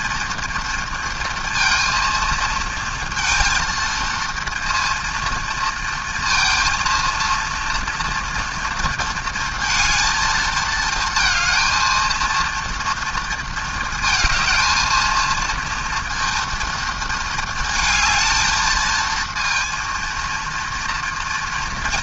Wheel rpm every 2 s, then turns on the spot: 230, 230, 230, 230, 230, 220, 230, 220, 230, 220, 230.
none